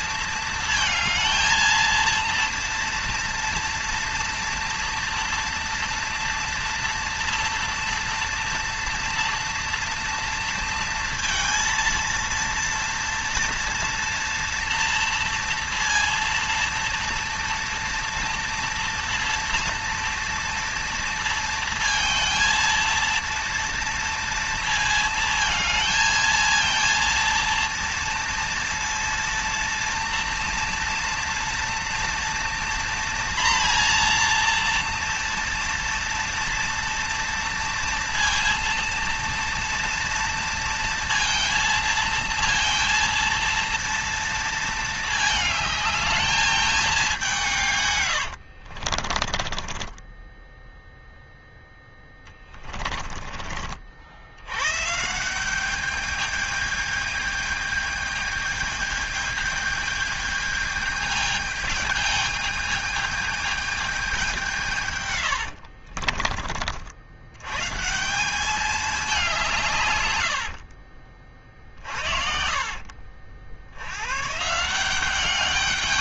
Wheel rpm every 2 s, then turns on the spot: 230, 230, 230, 230, 230, 230, 230, 230, 230, 230, 230, 230, 230, 230, 230, 230, 240, 240, 230, 230, 230, 230, 230, 220, 70, 10, 30, 100, 210, 210, 210, 210, 180, 50, 190, 70, 50, 150.
48-54 70-74